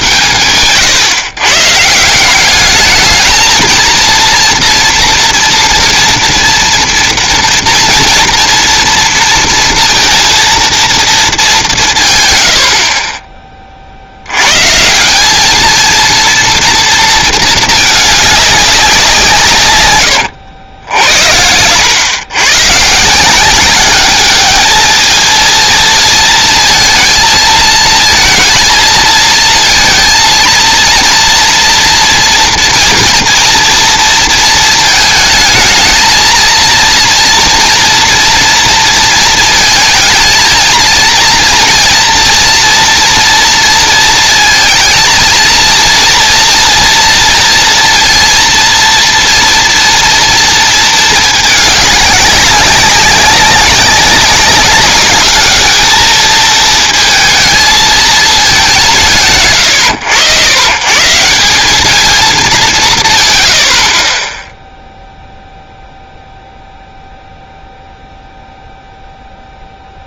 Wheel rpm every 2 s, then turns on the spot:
130, 200, 230, 230, 230, 230, 80, 120, 240, 200, 70, 130, 210, 220, 230, 230, 230, 230, 230, 230, 230, 230, 230, 240, 230, 230, 200, 200, 220, 210, 120, 180, 0, 0, 0.
none